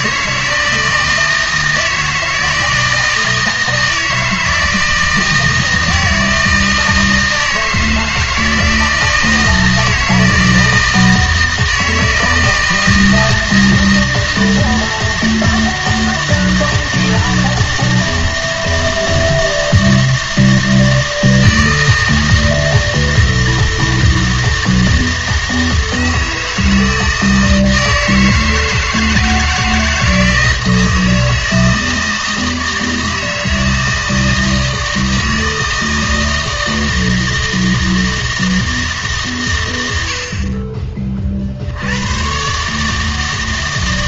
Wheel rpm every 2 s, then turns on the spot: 160, 160, 160, 160, 160, 160, 160, 160, 160, 160, 160, 160, 160, 160, 160, 160, 160, 160, 160, 160, 40, 130.
none